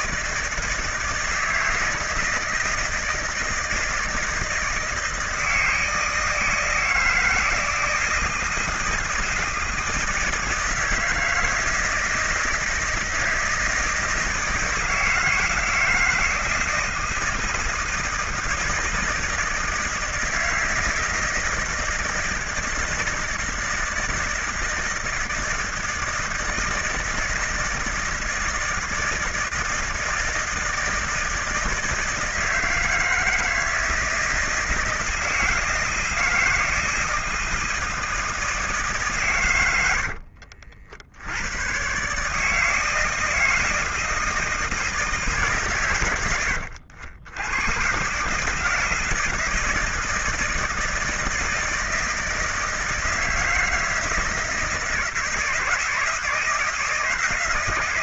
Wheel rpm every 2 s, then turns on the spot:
160, 160, 160, 160, 160, 160, 160, 160, 160, 160, 160, 160, 160, 160, 160, 160, 160, 160, 160, 150, 40, 150, 160, 100, 150, 160, 160, 160, 170.
none